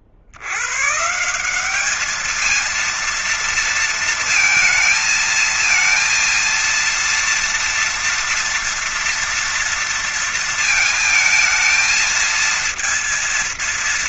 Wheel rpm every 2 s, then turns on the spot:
50, 210, 230, 230, 230, 230, 220.
none